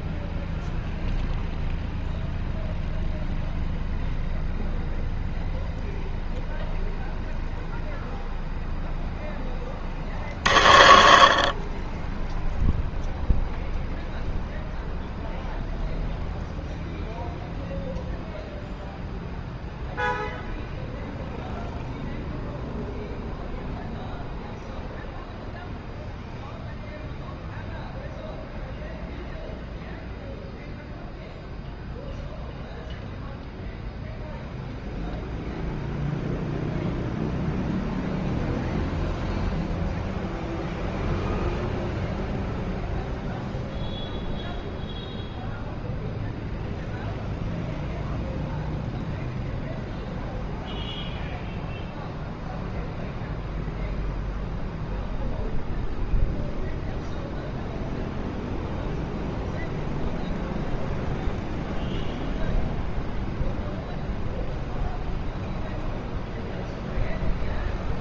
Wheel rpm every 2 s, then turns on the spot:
0, 0, 0, 0, 0, 70, 0, 0, 0, 0, 0, 0, 0, 0, 0, 0, 0, 0, 0, 0, 0, 0, 0, 0, 0, 0, 0, 0, 0, 0, 0, 0, 0, 0.
none